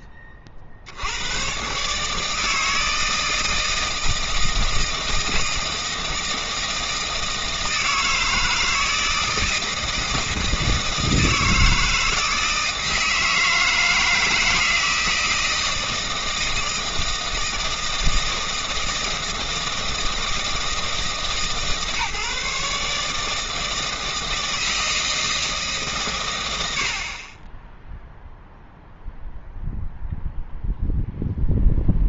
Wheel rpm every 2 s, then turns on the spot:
60, 160, 160, 160, 160, 160, 160, 160, 160, 160, 160, 150, 160, 80, 0, 0.
none